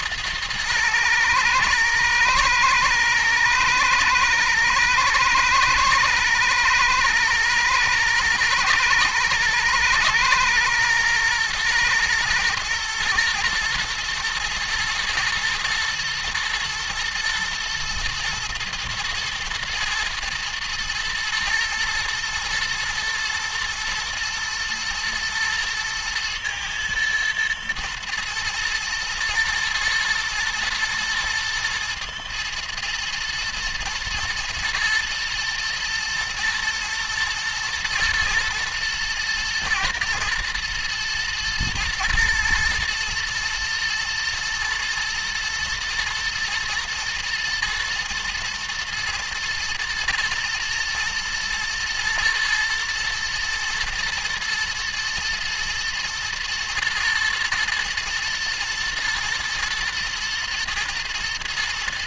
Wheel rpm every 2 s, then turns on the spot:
110, 120, 120, 120, 120, 110, 120, 110, 110, 110, 110, 110, 120, 110, 110, 110, 120, 120, 110, 110, 110, 120, 120, 120, 110, 120, 120, 120, 110, 110, 110.
none